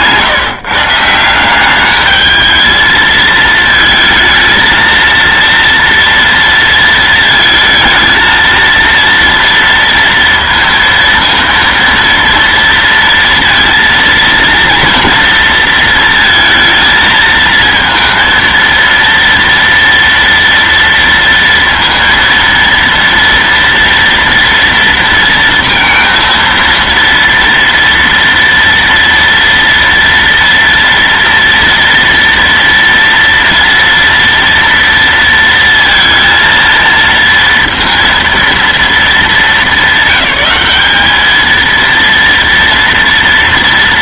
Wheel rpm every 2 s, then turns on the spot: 130, 210, 220, 230, 230, 230, 230, 230, 230, 230, 240, 230, 230, 230, 230, 230, 230, 230, 230, 230, 200, 230.
none